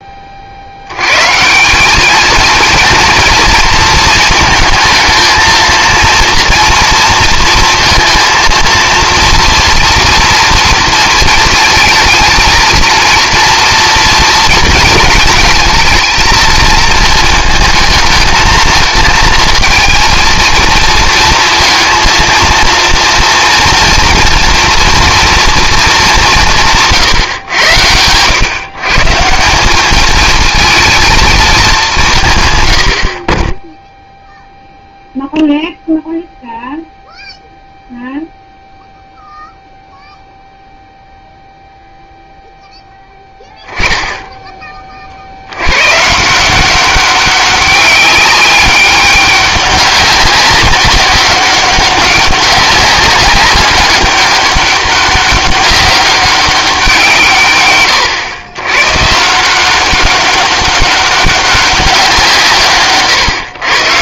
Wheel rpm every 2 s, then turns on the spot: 100, 230, 220, 230, 230, 230, 230, 230, 230, 230, 220, 230, 230, 150, 140, 220, 90, 0, 0, 0, 0, 0, 20, 180, 190, 190, 190, 200, 190, 110, 200, 150.
none